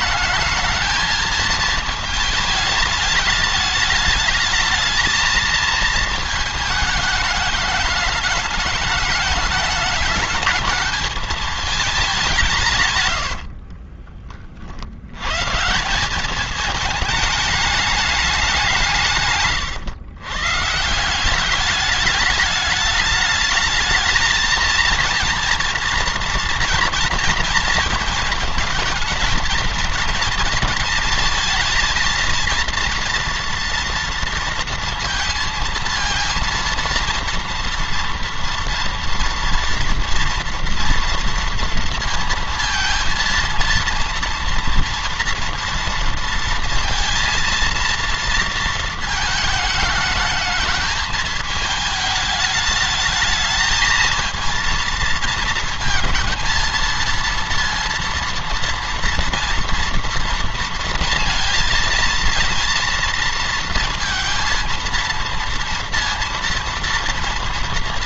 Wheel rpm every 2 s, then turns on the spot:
220, 210, 210, 220, 220, 220, 130, 90, 210, 160, 160, 210, 230, 240, 230, 220, 230, 230, 230, 240, 230, 230, 230, 230, 220, 210, 210, 230, 230, 230, 230, 230, 230, 230.
12-14 18-20